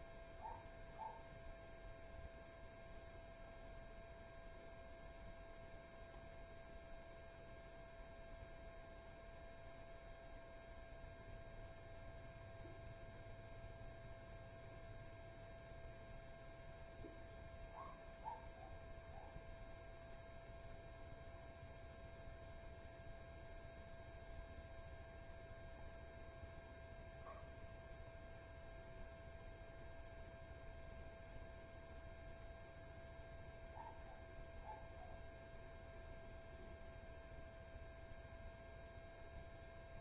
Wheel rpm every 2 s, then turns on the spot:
0, 0, 0, 0, 0, 0, 0, 0, 0, 0, 0, 0, 0, 0, 0, 0, 0, 0, 0, 0.
none